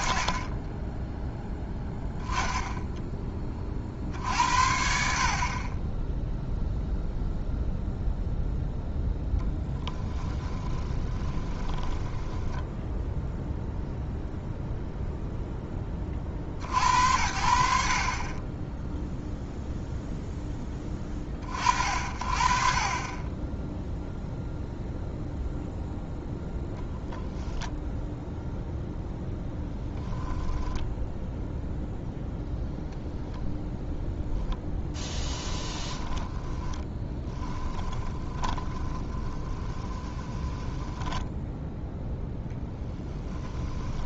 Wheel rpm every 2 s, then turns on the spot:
30, 10, 60, 0, 0, 20, 0, 0, 70, 10, 10, 40, 0, 0, 0, 0, 0, 10, 10, 20, 10, 10.
10-12 34-42